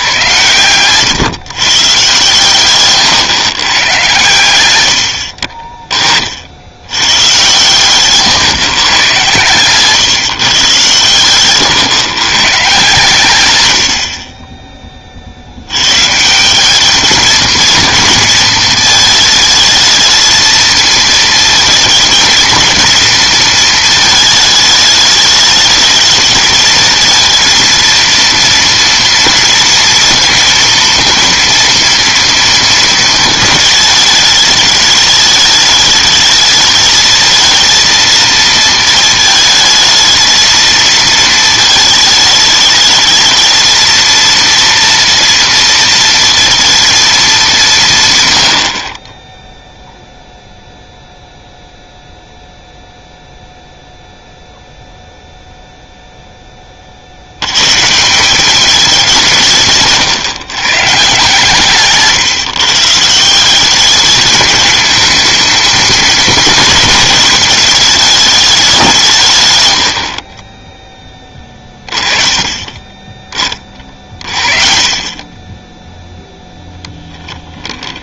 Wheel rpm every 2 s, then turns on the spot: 110, 130, 100, 80, 130, 140, 130, 20, 190, 220, 220, 220, 220, 220, 230, 230, 230, 210, 220, 230, 220, 220, 230, 230, 90, 0, 0, 0, 20, 200, 140, 140, 210, 220, 190, 10, 20, 30, 0.
72-74